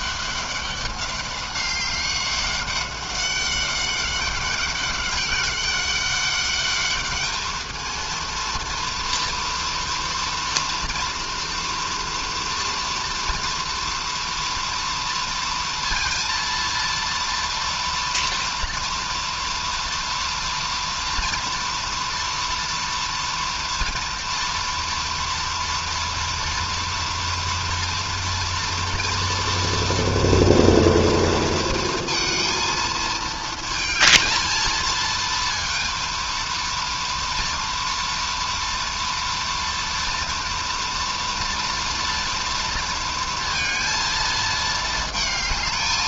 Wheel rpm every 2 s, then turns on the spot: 200, 200, 200, 200, 230, 230, 230, 230, 230, 230, 240, 230, 240, 230, 230, 230, 230, 220, 230, 230, 230, 230, 220.
none